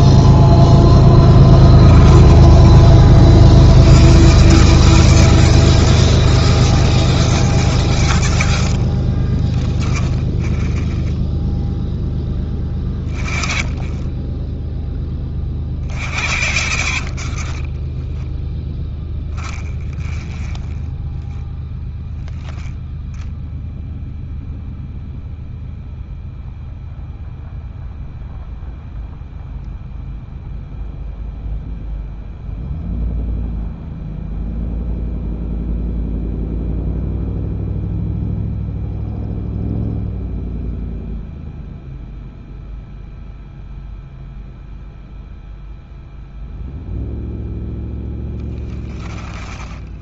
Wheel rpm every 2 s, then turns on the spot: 20, 40, 120, 110, 60, 10, 20, 10, 50, 10, 10, 0, 0, 0, 0, 0, 0, 0, 0, 0, 0, 0, 0, 0, 20.
0-2 8-10 16-22